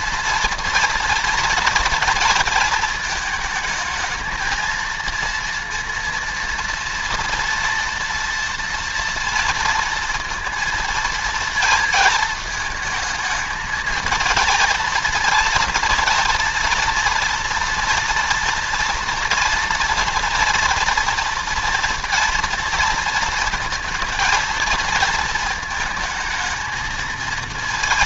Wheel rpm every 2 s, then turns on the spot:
230, 230, 230, 230, 230, 230, 220, 230, 230, 230, 230, 230, 230, 220.
none